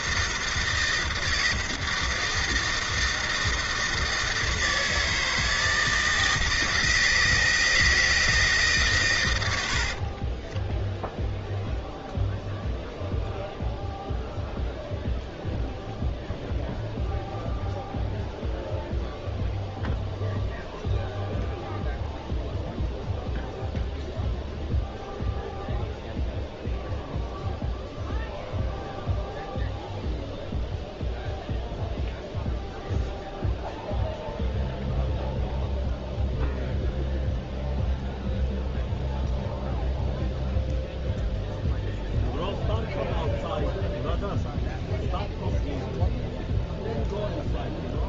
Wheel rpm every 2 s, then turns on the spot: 160, 160, 160, 160, 150, 10, 0, 0, 0, 0, 0, 0, 0, 0, 0, 0, 0, 0, 0, 0, 0, 0, 0, 0.
10-12